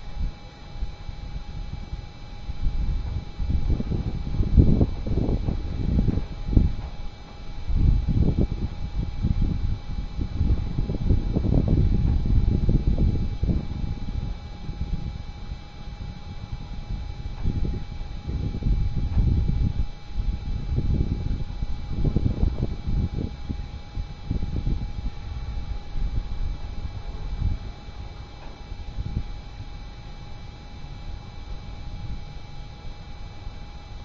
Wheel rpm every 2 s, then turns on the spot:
0, 0, 0, 0, 0, 0, 0, 0, 0, 0, 0, 0, 0, 0, 0, 0, 0.
none